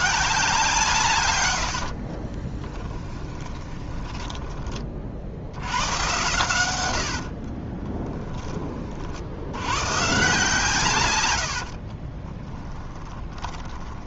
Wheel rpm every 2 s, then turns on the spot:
140, 10, 30, 90, 30, 140, 20.
2-4 6-8 12-14